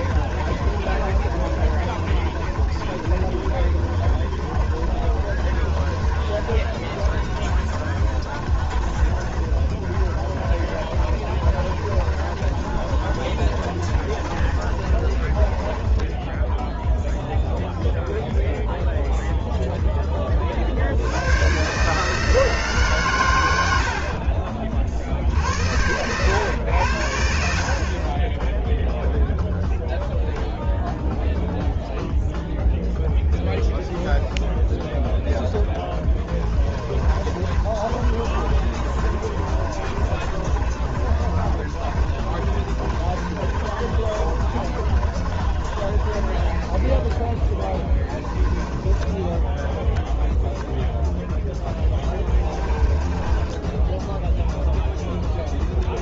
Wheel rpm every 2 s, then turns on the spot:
30, 40, 30, 30, 30, 30, 40, 30, 0, 0, 60, 140, 50, 80, 0, 0, 0, 0, 20, 30, 40, 30, 30, 20, 10, 0, 20, 0.
0-16 36-50 52-54